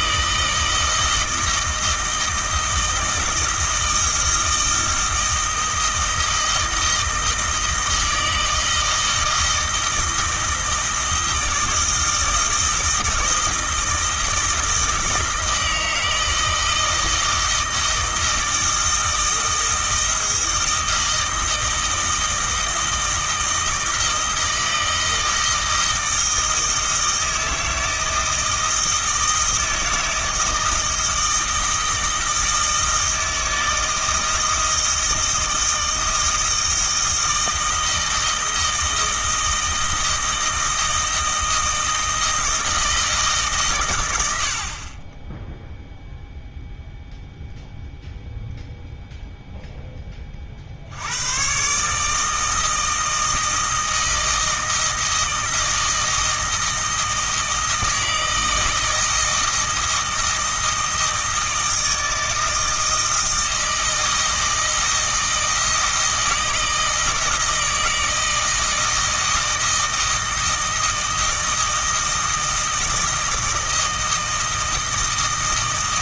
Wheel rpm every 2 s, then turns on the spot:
160, 160, 160, 160, 160, 160, 160, 160, 160, 160, 160, 160, 160, 160, 160, 160, 160, 160, 160, 160, 160, 160, 40, 0, 0, 60, 160, 160, 160, 160, 160, 160, 160, 160, 160, 160, 160, 160.
none